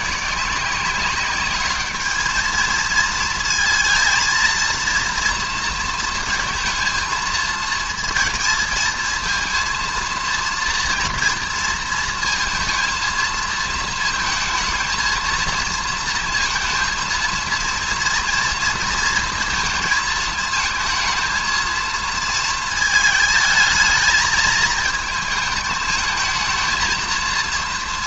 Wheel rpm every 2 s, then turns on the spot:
170, 220, 230, 230, 230, 230, 230, 220, 230, 230, 220, 230, 220, 220.
none